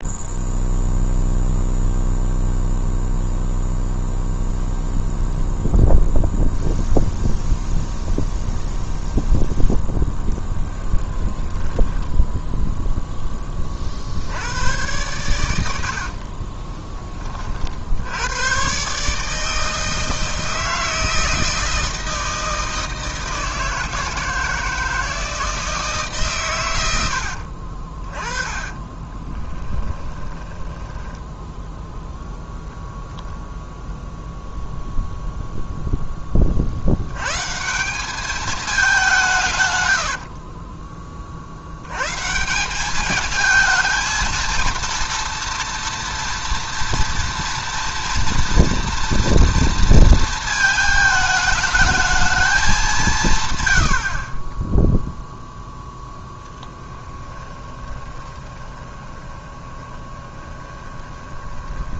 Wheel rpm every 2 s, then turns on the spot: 0, 0, 0, 0, 0, 10, 0, 100, 20, 130, 160, 160, 160, 100, 20, 10, 0, 0, 70, 190, 20, 190, 230, 230, 230, 220, 210, 10, 10, 20, 20.
10-12 28-32 56-62